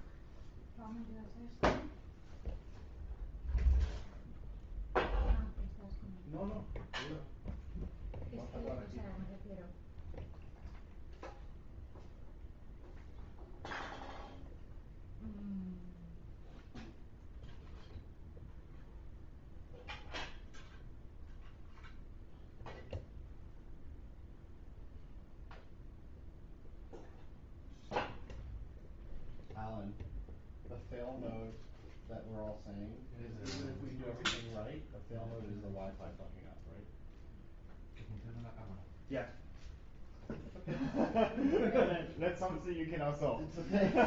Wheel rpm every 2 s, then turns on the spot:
0, 0, 0, 0, 0, 0, 0, 0, 0, 0, 0, 0, 0, 0, 0, 0, 0, 0, 0, 0, 0, 0.
none